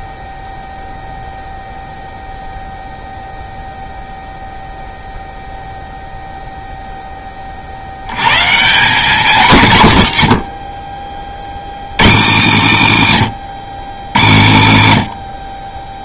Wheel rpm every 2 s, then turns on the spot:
0, 0, 0, 0, 160, 60, 90, 60.
none